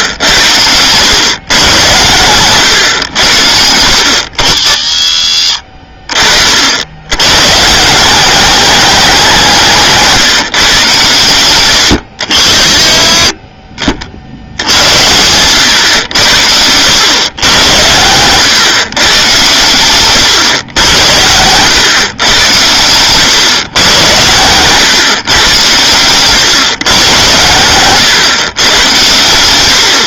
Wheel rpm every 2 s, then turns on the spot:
100, 110, 60, 70, 210, 140, 40, 90, 90, 130, 110, 110, 120, 130, 110.
none